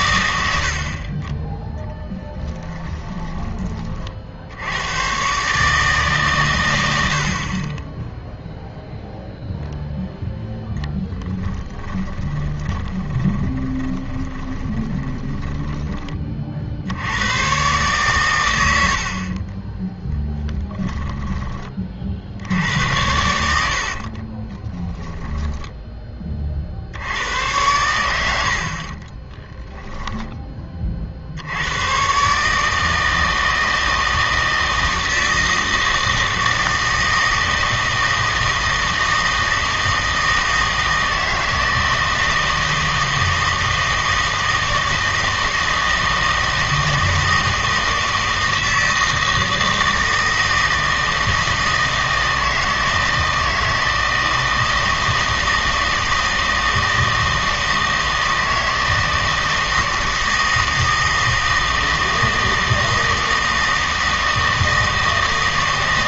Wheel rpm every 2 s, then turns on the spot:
80, 10, 80, 100, 0, 0, 20, 20, 60, 90, 10, 70, 20, 40, 60, 30, 150, 160, 160, 160, 160, 160, 160, 160, 160, 160, 160, 160, 160, 160, 160, 160, 160.
12-16 20-22 24-26